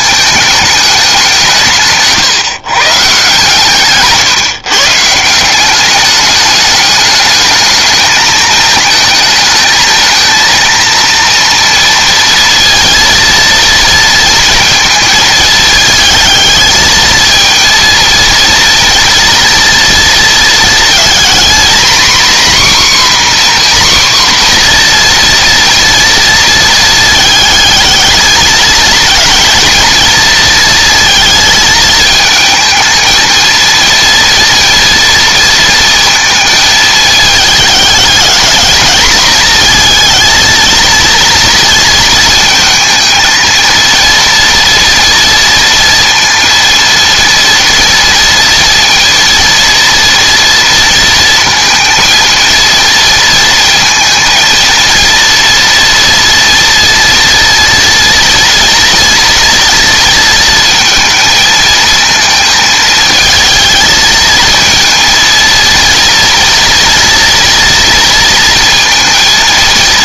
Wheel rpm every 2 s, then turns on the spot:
210, 140, 150, 210, 220, 230, 230, 230, 220, 230, 230, 260, 240, 230, 230, 230, 220, 230, 220, 210, 230, 230, 230, 230, 230, 230, 230, 230, 230, 230, 230, 220, 220, 230, 230.
none